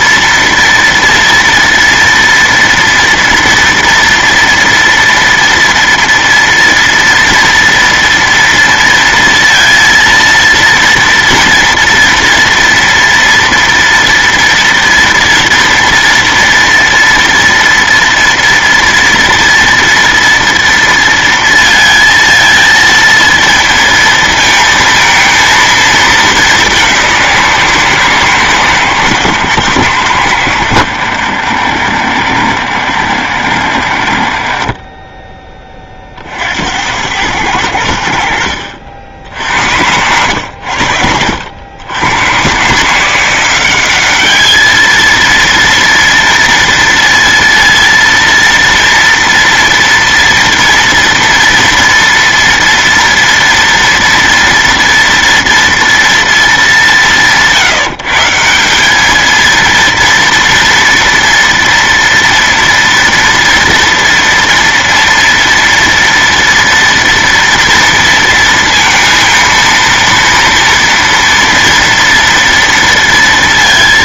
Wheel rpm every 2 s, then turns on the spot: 230, 230, 230, 230, 230, 230, 230, 230, 230, 230, 230, 220, 230, 200, 140, 90, 50, 20, 60, 60, 80, 110, 210, 230, 230, 230, 230, 230, 210, 170, 230, 230, 230, 230, 230, 230, 230.
none